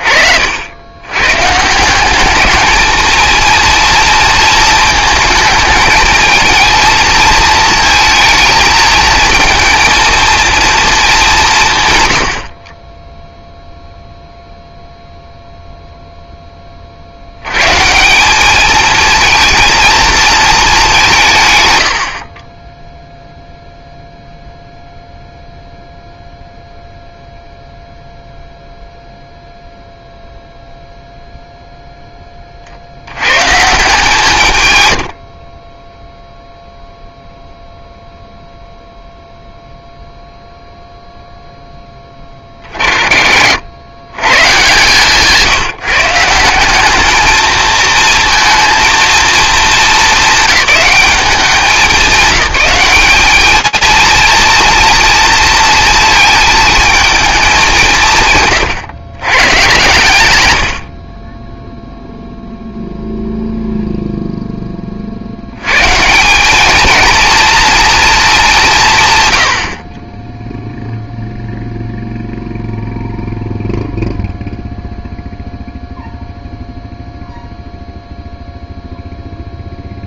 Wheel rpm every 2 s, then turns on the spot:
80, 210, 230, 220, 220, 230, 50, 0, 20, 210, 220, 20, 0, 0, 0, 0, 40, 120, 0, 0, 0, 30, 160, 190, 230, 210, 200, 230, 220, 130, 90, 0, 40, 230, 140, 0, 0, 0, 0, 0.
12-14 58-60